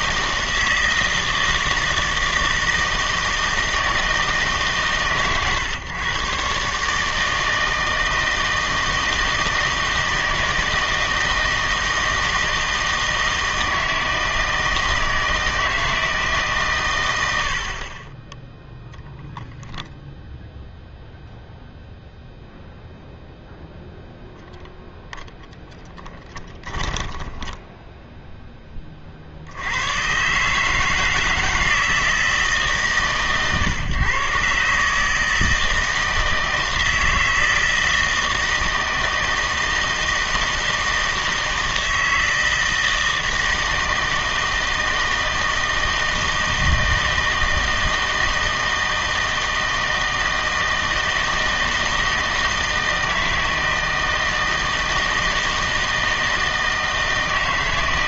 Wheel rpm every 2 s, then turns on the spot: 160, 160, 140, 140, 160, 160, 160, 160, 130, 0, 0, 0, 0, 10, 20, 150, 150, 140, 160, 160, 160, 160, 160, 160, 160, 160, 160, 160, 160.
26-28